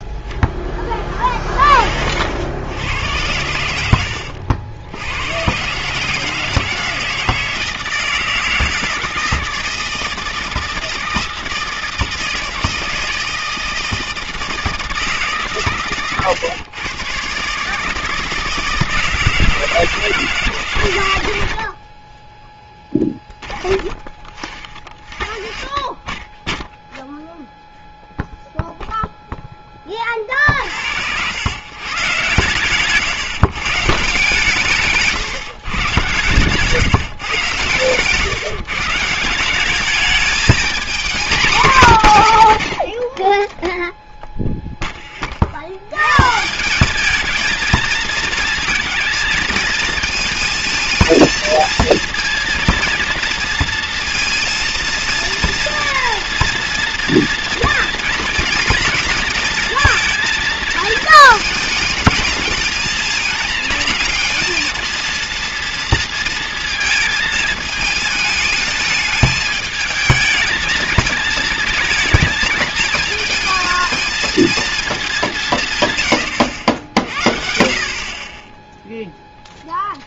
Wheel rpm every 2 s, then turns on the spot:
20, 100, 90, 160, 160, 160, 160, 160, 120, 160, 110, 10, 30, 10, 0, 70, 140, 150, 150, 150, 230, 110, 10, 190, 230, 220, 230, 230, 230, 230, 220, 220, 230, 220, 220, 220, 220, 220, 80, 10.
none